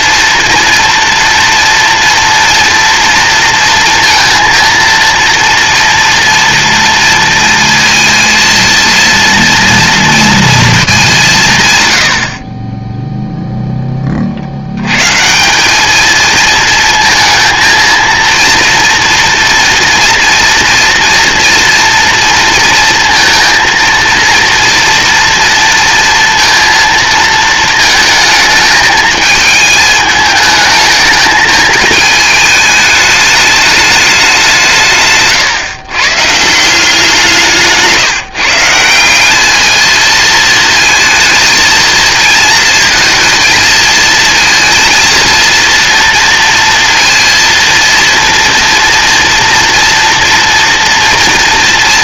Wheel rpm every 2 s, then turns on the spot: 230, 230, 230, 230, 230, 210, 10, 110, 230, 230, 240, 230, 230, 230, 220, 220, 210, 150, 180, 170, 220, 230, 230, 230, 230, 230.
none